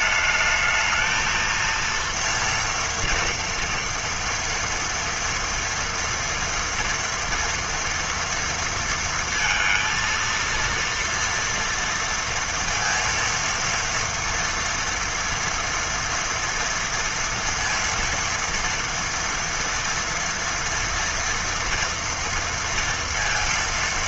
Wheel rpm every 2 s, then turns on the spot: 220, 230, 230, 240, 230, 230, 230, 230, 230, 230, 230, 230.
none